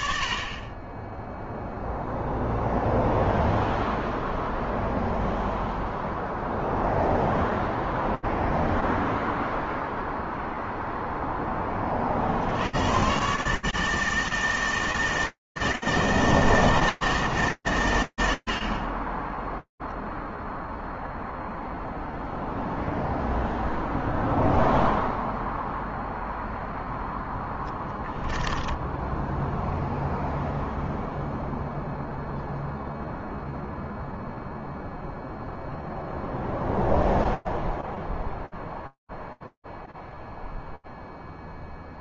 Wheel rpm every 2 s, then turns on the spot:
0, 0, 0, 0, 0, 0, 130, 160, 160, 20, 0, 0, 0, 10, 10, 0, 0, 0, 0, 0, 0.
26-30